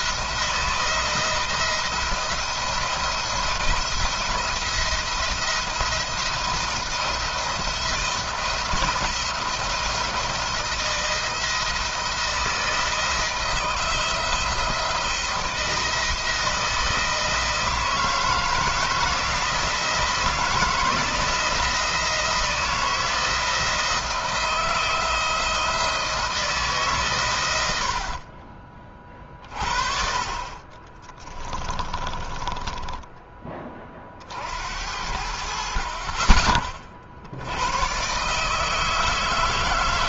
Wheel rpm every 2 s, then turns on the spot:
170, 160, 170, 170, 170, 170, 170, 170, 170, 160, 170, 170, 160, 150, 30, 40, 10, 60, 40, 150.
30-32